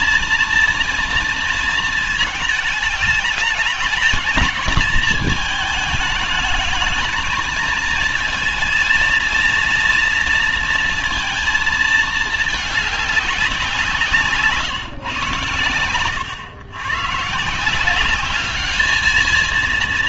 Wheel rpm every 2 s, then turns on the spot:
230, 220, 230, 220, 220, 230, 210, 140, 100, 200.
none